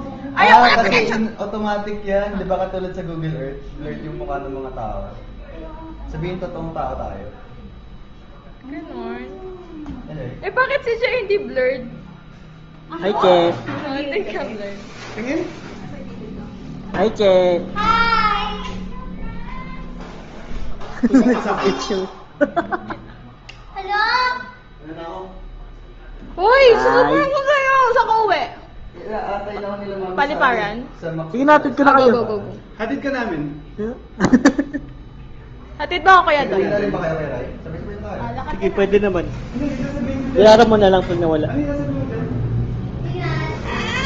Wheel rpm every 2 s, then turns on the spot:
0, 0, 0, 0, 0, 0, 0, 0, 0, 0, 0, 0, 0, 0, 0, 0, 0, 0, 0, 0, 0, 0.
none